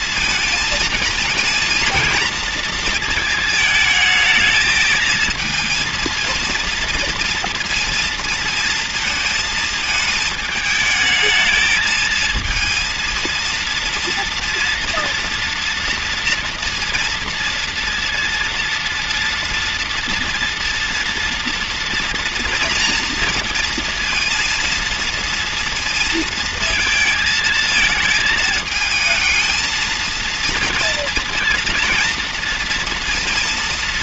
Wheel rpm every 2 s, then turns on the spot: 220, 220, 220, 230, 230, 220, 220, 230, 230, 230, 230, 230, 230, 230, 220, 230, 230.
none